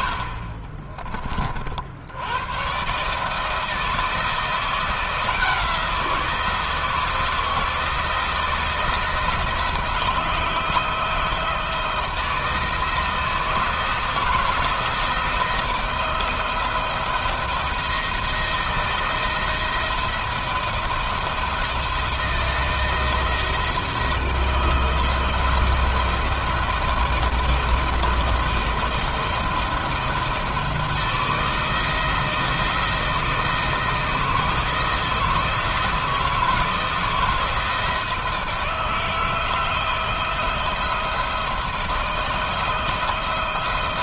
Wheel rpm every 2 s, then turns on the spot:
30, 120, 170, 170, 170, 170, 160, 160, 170, 170, 170, 160, 160, 170, 170, 160, 170, 160, 160, 160, 170, 160.
0-2